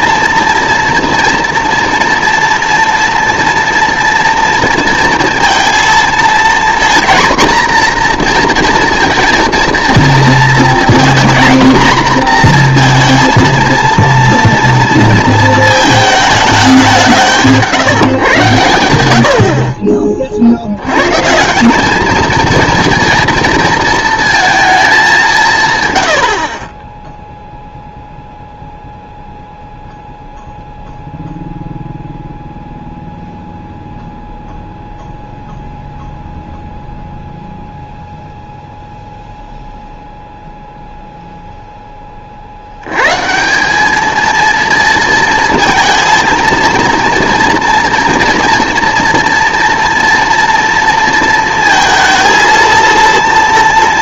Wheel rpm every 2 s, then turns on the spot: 230, 240, 230, 230, 230, 230, 240, 230, 210, 110, 70, 220, 230, 50, 0, 0, 0, 0, 0, 0, 0, 70, 220, 230, 230, 230, 230.
26-28